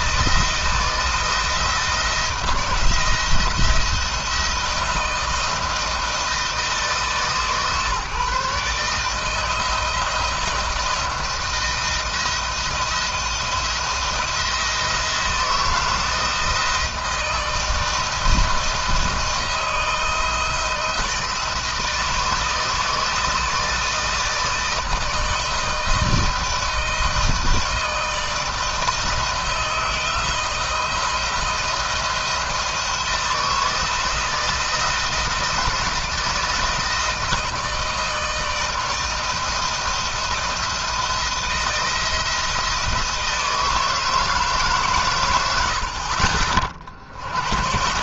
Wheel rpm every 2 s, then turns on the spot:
170, 170, 160, 160, 150, 170, 170, 170, 160, 170, 160, 160, 160, 160, 160, 160, 160, 160, 160, 160, 170, 160, 150, 60.
none